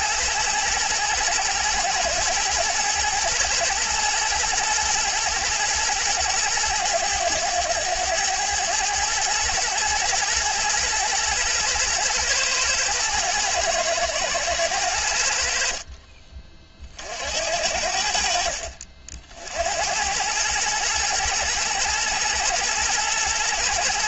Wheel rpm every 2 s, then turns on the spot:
110, 110, 110, 110, 110, 110, 110, 90, 50, 60, 120, 120.
none